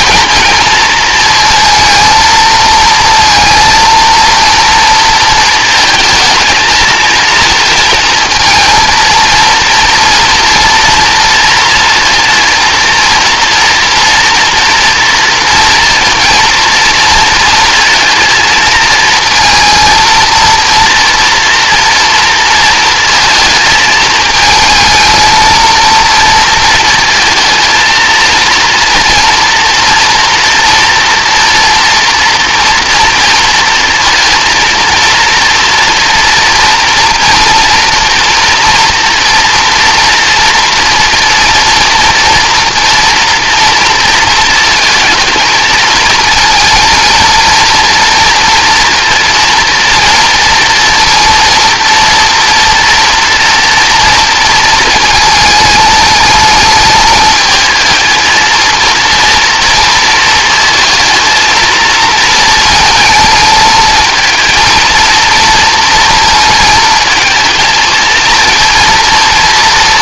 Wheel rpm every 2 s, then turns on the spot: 230, 230, 230, 220, 230, 240, 230, 230, 230, 230, 230, 230, 220, 230, 230, 230, 230, 230, 240, 240, 230, 240, 220, 230, 230, 230, 230, 220, 220, 230, 220, 230, 230, 230, 230.
none